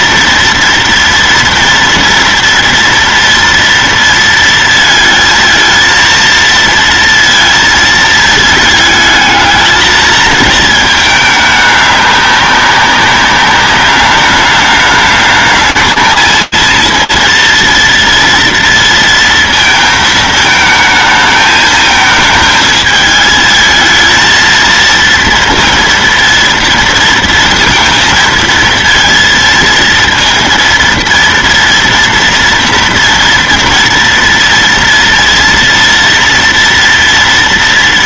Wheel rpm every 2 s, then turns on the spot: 230, 240, 230, 230, 220, 220, 200, 210, 230, 230, 220, 220, 230, 230, 230, 230, 230, 230, 230.
none